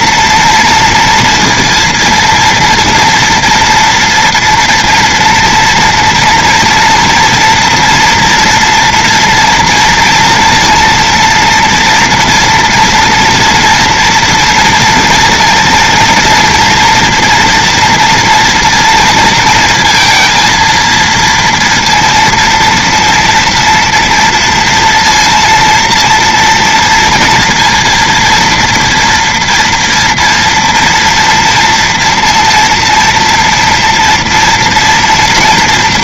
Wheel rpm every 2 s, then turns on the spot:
230, 230, 230, 230, 240, 230, 240, 230, 230, 230, 230, 230, 230, 230, 230, 230, 230, 230.
none